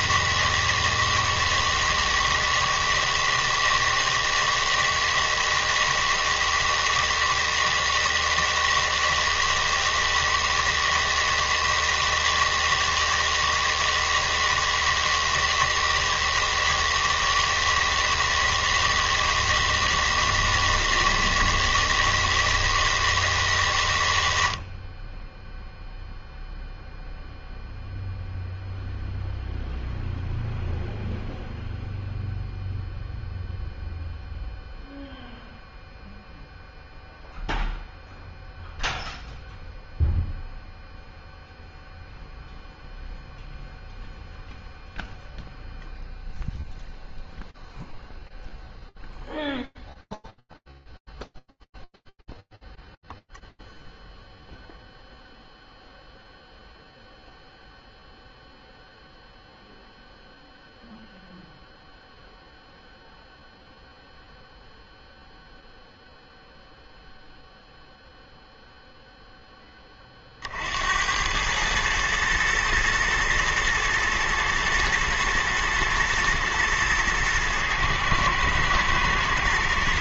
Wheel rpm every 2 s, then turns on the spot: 160, 160, 160, 160, 160, 160, 160, 160, 160, 160, 160, 160, 40, 0, 0, 0, 0, 0, 0, 0, 0, 0, 0, 0, 0, 0, 0, 0, 0, 0, 0, 0, 0, 0, 30, 110, 110, 120, 110, 120.
none